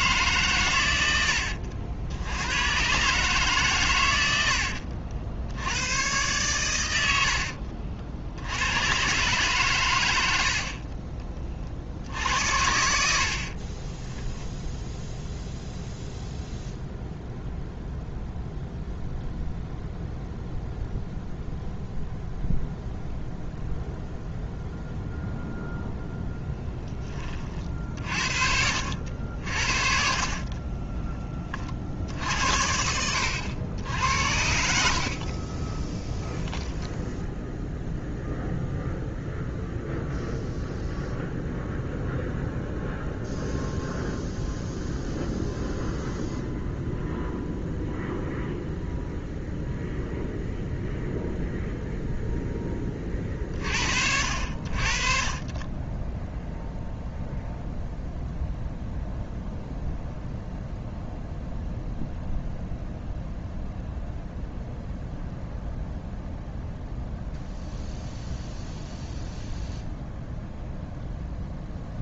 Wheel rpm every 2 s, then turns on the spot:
110, 120, 70, 90, 110, 50, 70, 0, 0, 0, 0, 0, 0, 10, 70, 20, 70, 60, 0, 0, 0, 0, 0, 0, 0, 0, 20, 50, 0, 0, 0, 0, 0, 0, 0, 0.
4-6 30-32